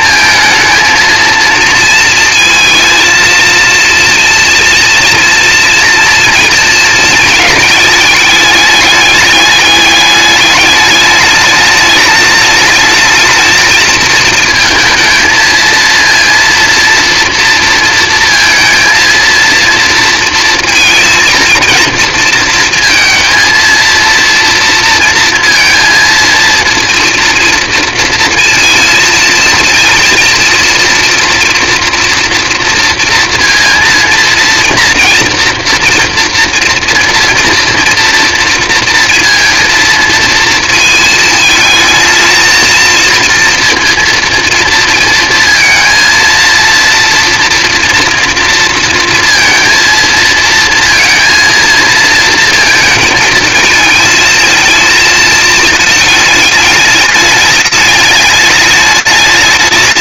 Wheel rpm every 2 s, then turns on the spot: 220, 230, 230, 230, 210, 210, 220, 220, 230, 230, 230, 230, 230, 230, 230, 230, 230, 230, 240, 230, 230, 230, 230, 230, 230, 230, 230, 220, 220, 210.
none